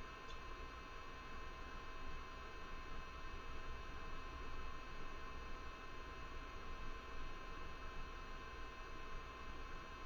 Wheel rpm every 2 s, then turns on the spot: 0, 0, 0, 0, 0.
none